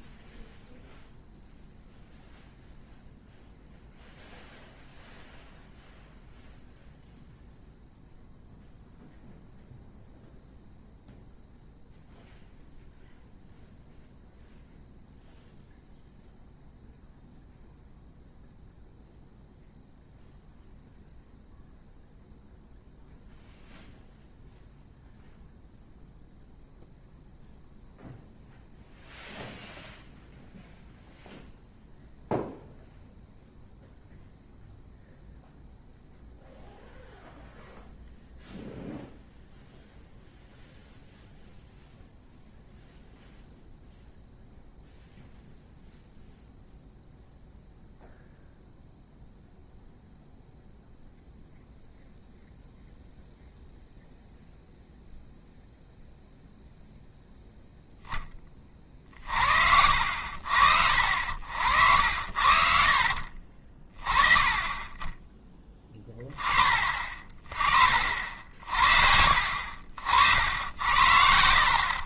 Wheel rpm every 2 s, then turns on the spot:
0, 0, 0, 0, 0, 0, 0, 0, 0, 0, 0, 0, 0, 0, 0, 0, 0, 0, 0, 0, 0, 0, 0, 0, 0, 0, 0, 0, 0, 20, 60, 60, 20, 20, 60, 70.
62-64 70-72